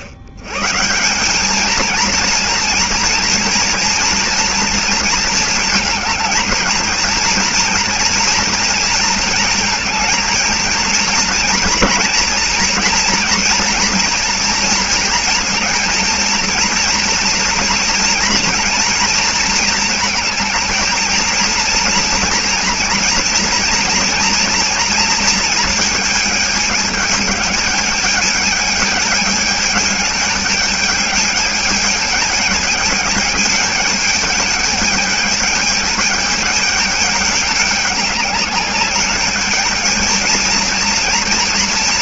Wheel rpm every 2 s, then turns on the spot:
150, 230, 230, 230, 230, 230, 240, 230, 230, 230, 220, 230, 230, 210, 210, 210, 210, 210, 210, 200, 230.
none